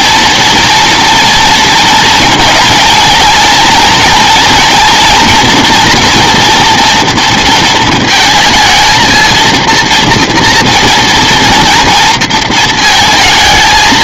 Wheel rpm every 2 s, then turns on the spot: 230, 230, 240, 230, 220, 230, 230.
none